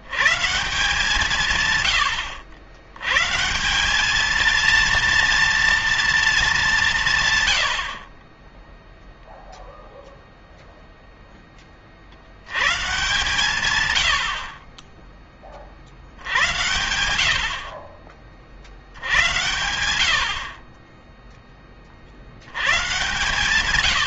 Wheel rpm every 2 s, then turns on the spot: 160, 110, 230, 190, 10, 0, 120, 20, 100, 60, 40, 110.
none